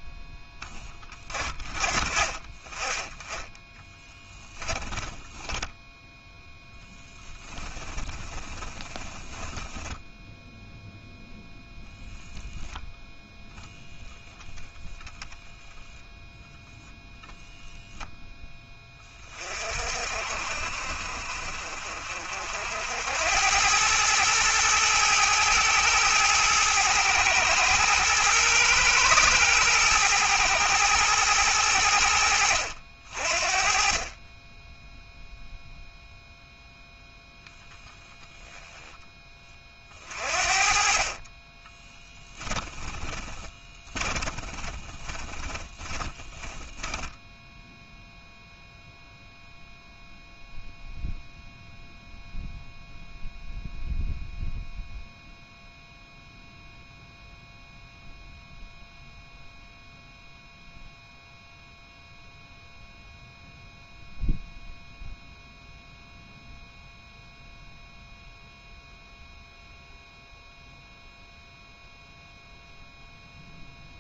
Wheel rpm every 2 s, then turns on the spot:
20, 20, 20, 10, 20, 0, 10, 10, 0, 20, 50, 80, 110, 110, 110, 110, 60, 0, 0, 10, 40, 20, 20, 10, 0, 0, 0, 0, 0, 0, 0, 0, 0, 0, 0, 0, 0.
4-10 42-48